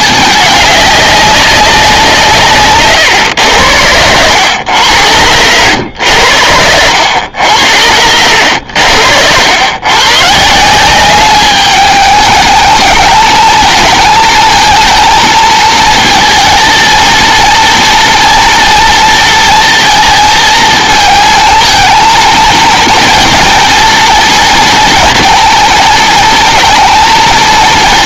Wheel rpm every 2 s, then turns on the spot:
200, 130, 90, 90, 90, 180, 220, 230, 230, 230, 220, 230, 230, 230.
none